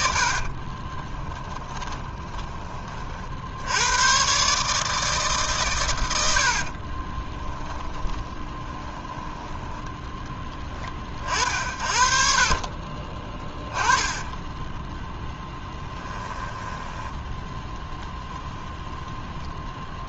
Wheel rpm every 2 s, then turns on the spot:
30, 30, 150, 40, 10, 30, 30, 10, 10, 0.
0-2 6-10 12-16